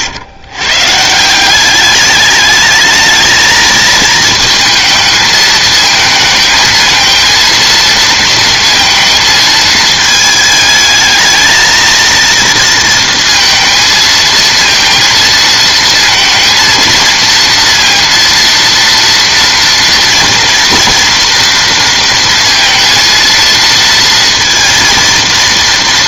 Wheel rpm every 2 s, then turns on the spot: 130, 220, 220, 220, 230, 220, 230, 230, 230, 230, 230, 230, 230.
none